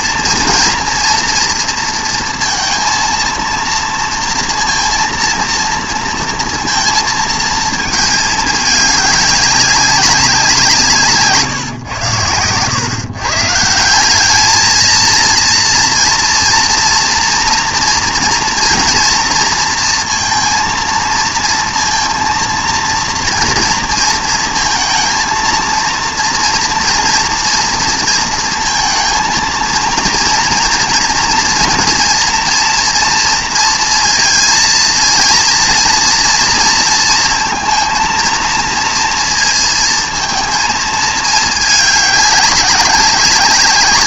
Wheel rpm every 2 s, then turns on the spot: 230, 230, 230, 230, 200, 170, 120, 220, 230, 230, 230, 230, 230, 230, 230, 230, 230, 230, 230, 230, 220, 190.
none